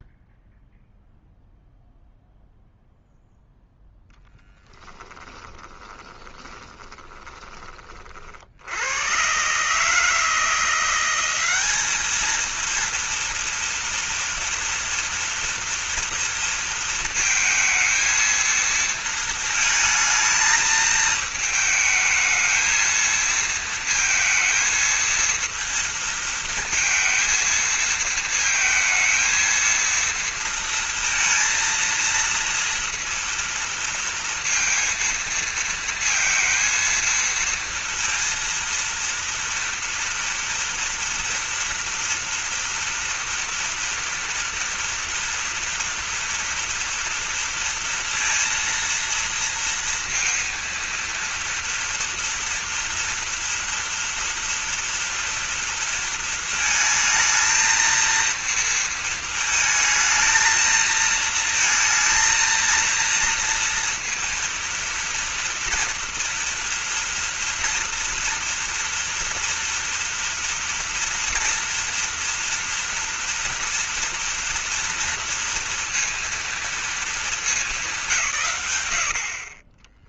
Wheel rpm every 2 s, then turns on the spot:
0, 0, 10, 20, 90, 170, 230, 240, 230, 230, 220, 220, 220, 230, 230, 230, 230, 230, 230, 230, 230, 230, 230, 230, 230, 230, 230, 230, 220, 230, 230, 230, 230, 230, 230, 230, 230, 230, 220, 90.
4-8